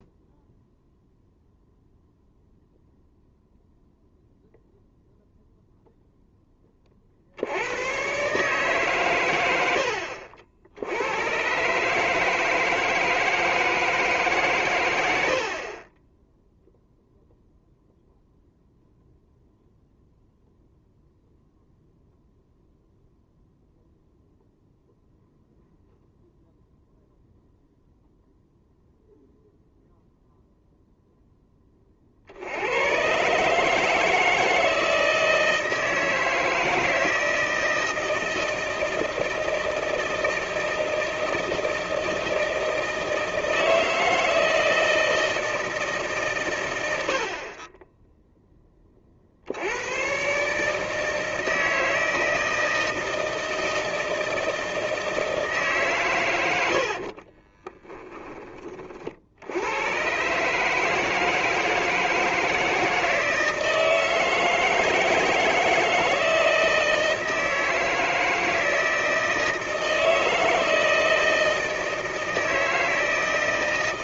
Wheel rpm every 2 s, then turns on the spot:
0, 0, 0, 10, 140, 70, 160, 130, 0, 0, 0, 0, 0, 0, 0, 0, 80, 160, 160, 160, 160, 160, 160, 140, 10, 150, 160, 160, 90, 20, 140, 160, 160, 160, 160, 160, 160.
none